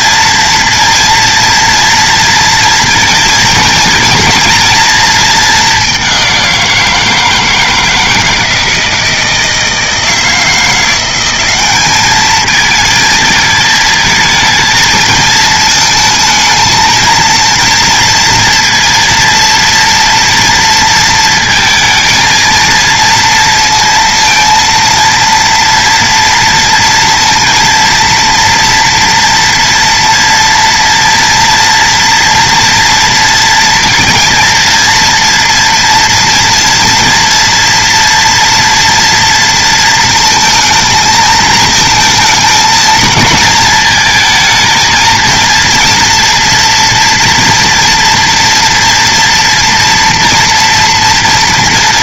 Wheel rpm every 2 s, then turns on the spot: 230, 230, 230, 180, 160, 170, 220, 220, 230, 230, 230, 230, 230, 230, 230, 230, 240, 230, 230, 230, 220, 230, 230, 240, 240, 230.
none